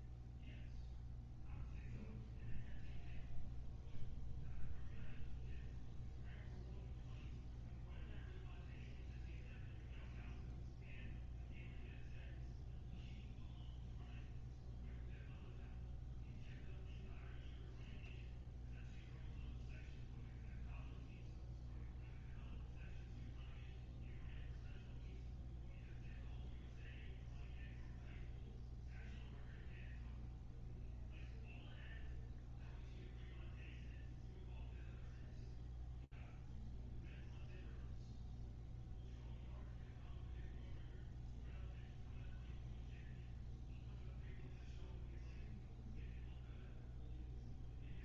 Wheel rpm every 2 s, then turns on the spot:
0, 0, 0, 0, 0, 0, 0, 0, 0, 0, 0, 0, 0, 0, 0, 0, 0, 0, 0, 0, 0, 0, 0, 0.
none